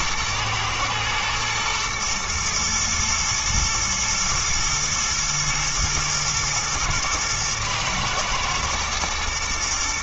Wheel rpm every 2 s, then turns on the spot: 120, 110, 120, 110, 110.
none